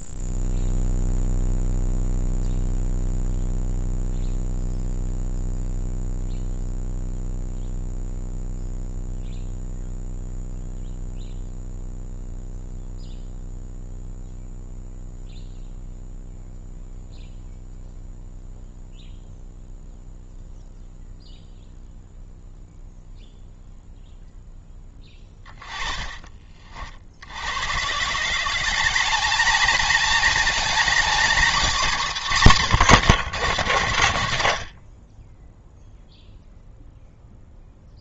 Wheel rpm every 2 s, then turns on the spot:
0, 0, 0, 0, 0, 0, 0, 0, 0, 0, 0, 0, 10, 50, 190, 230, 130, 30, 0.
24-26